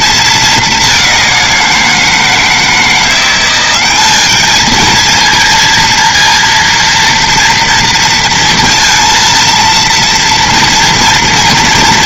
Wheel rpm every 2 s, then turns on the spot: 210, 160, 220, 230, 230, 240.
none